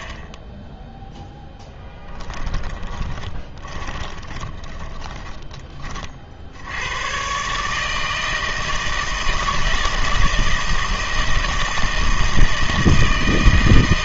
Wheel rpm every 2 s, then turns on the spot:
10, 20, 20, 80, 160, 160, 160.
2-6